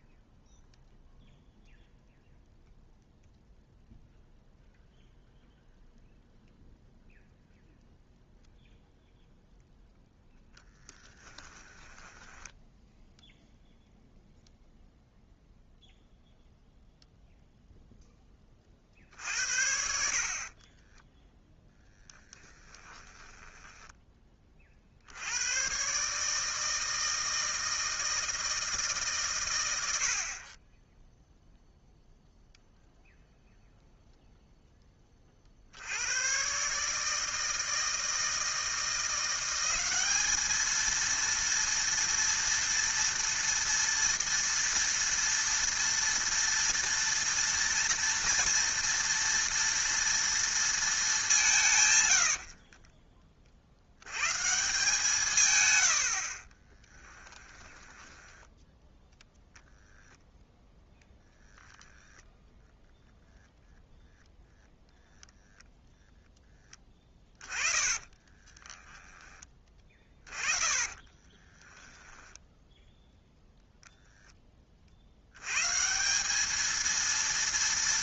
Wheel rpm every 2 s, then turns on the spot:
0, 0, 0, 0, 0, 10, 10, 0, 0, 40, 20, 10, 40, 160, 160, 30, 0, 0, 140, 160, 220, 230, 230, 230, 230, 230, 50, 150, 20, 10, 10, 0, 0, 10, 20, 30, 0, 30, 210.
10-14 20-24 52-54 56-58 68-72